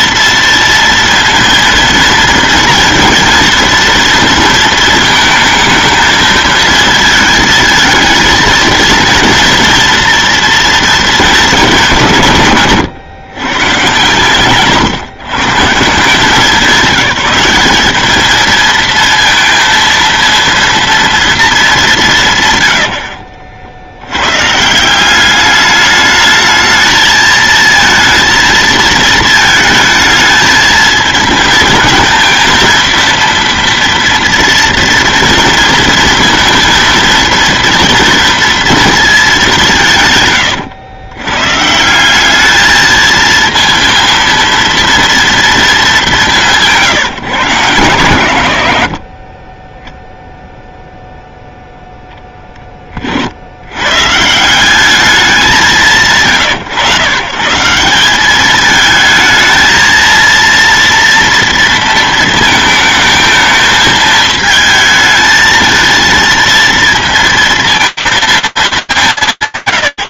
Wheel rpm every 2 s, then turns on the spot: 230, 230, 230, 220, 230, 230, 140, 130, 190, 230, 230, 110, 160, 220, 230, 220, 230, 230, 230, 230, 110, 220, 230, 160, 100, 0, 20, 190, 130, 210, 230, 220, 220, 230, 210.
none